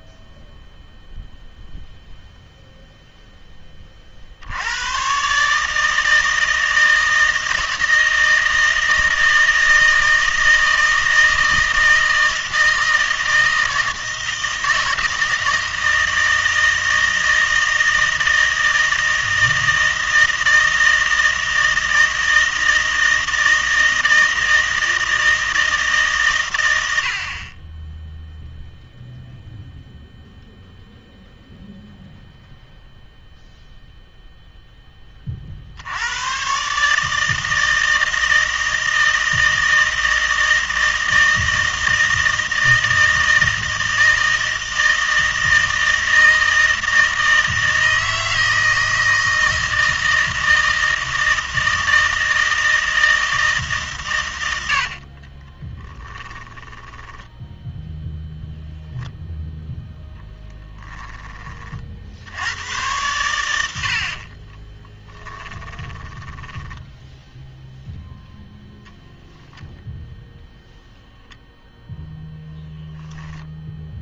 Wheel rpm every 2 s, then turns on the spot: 0, 0, 90, 160, 160, 160, 160, 160, 160, 160, 160, 160, 160, 120, 0, 0, 0, 10, 140, 160, 160, 160, 160, 160, 160, 160, 160, 80, 10, 0, 10, 100, 20, 10, 0, 0, 0.
56-58 60-62 64-68